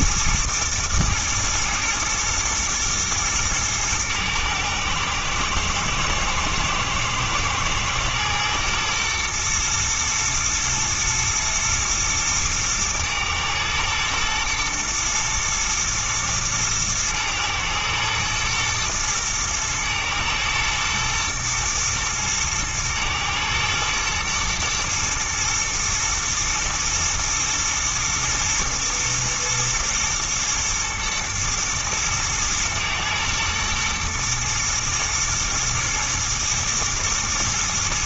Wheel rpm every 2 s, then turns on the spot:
110, 110, 110, 120, 120, 120, 120, 120, 110, 110, 120, 110, 120, 110, 120, 110, 110, 120, 110.
none